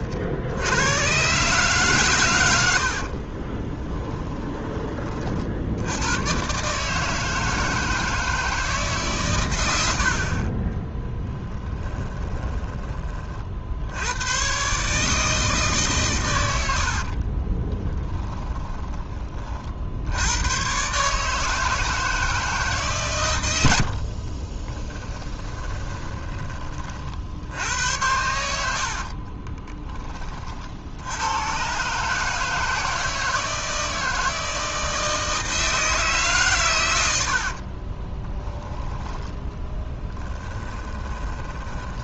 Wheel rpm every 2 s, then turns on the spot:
100, 70, 20, 140, 160, 20, 20, 140, 70, 20, 130, 140, 20, 30, 70, 60, 160, 160, 100, 10, 20.
2-4 10-12 16-20 24-26 40-42